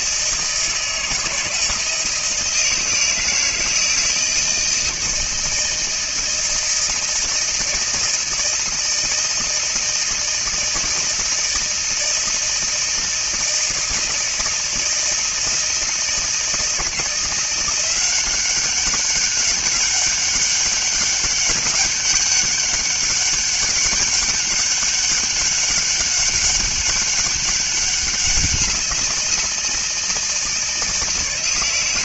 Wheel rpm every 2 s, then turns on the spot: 160, 160, 160, 160, 160, 160, 160, 160, 160, 200, 200, 200, 200, 200, 180, 160.
none